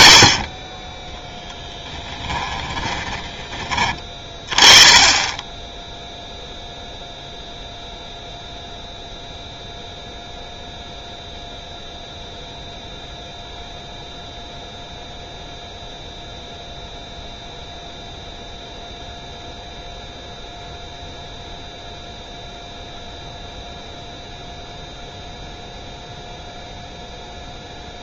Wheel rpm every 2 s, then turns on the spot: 40, 10, 30, 0, 0, 0, 0, 0, 0, 0, 0, 0, 0, 0.
2-4